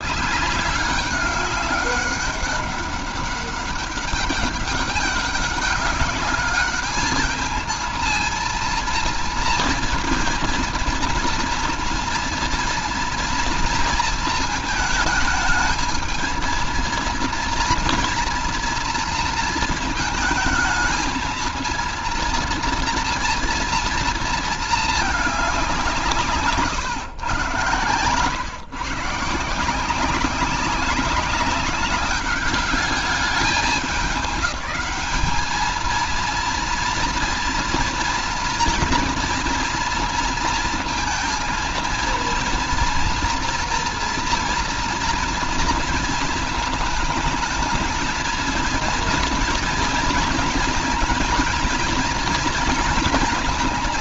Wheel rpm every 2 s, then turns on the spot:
200, 200, 200, 200, 230, 230, 230, 220, 230, 230, 220, 230, 220, 160, 130, 190, 200, 190, 230, 230, 230, 230, 230, 220, 230, 230, 230.
26-28